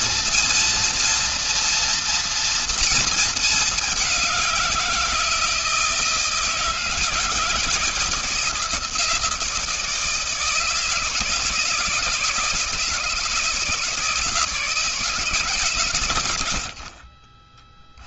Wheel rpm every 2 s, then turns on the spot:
230, 230, 180, 160, 170, 160, 150, 160, 100.
none